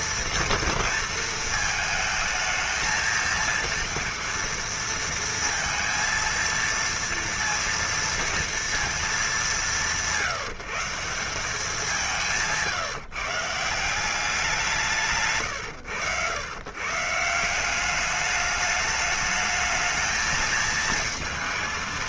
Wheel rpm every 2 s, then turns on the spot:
230, 220, 230, 230, 230, 180, 150, 170, 120, 210, 220.
none